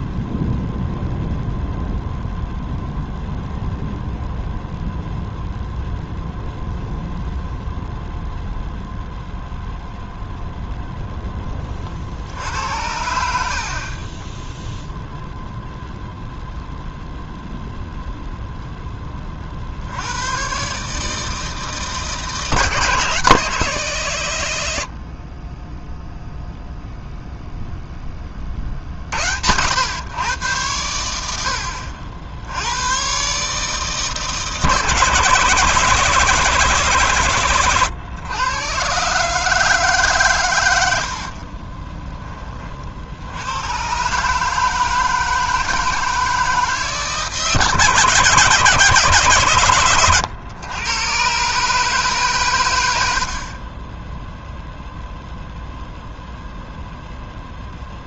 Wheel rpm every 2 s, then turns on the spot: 0, 0, 0, 0, 0, 0, 70, 10, 0, 0, 120, 160, 100, 0, 30, 110, 80, 150, 170, 120, 120, 30, 150, 160, 160, 110, 130, 0, 0.
14-16